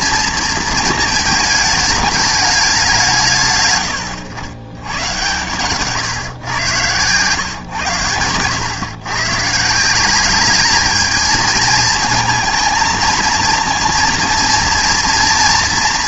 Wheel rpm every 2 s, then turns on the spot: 230, 200, 100, 130, 120, 210, 220, 230.
none